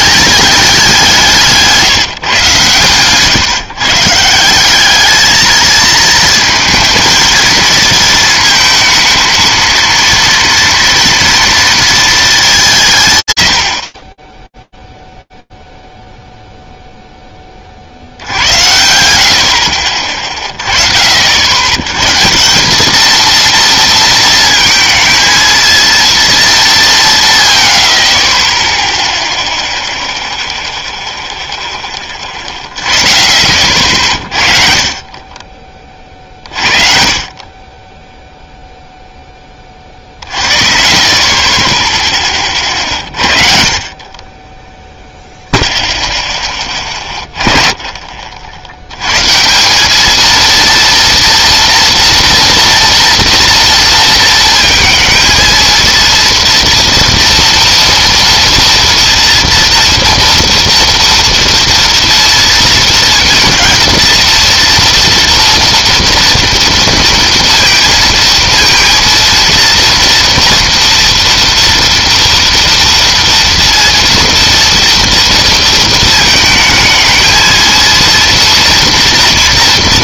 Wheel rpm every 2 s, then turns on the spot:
200, 130, 180, 220, 220, 230, 180, 0, 0, 90, 30, 180, 220, 210, 10, 0, 20, 50, 40, 0, 40, 40, 0, 20, 120, 230, 230, 230, 230, 230, 230, 230, 230, 230, 230, 240, 230, 230, 220, 240.
none